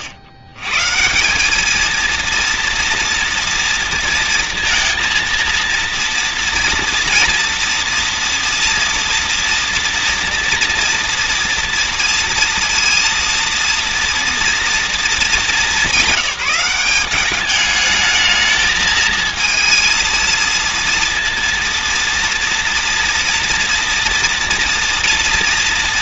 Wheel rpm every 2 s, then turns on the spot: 70, 230, 230, 230, 230, 230, 230, 230, 200, 210, 230, 230, 230.
none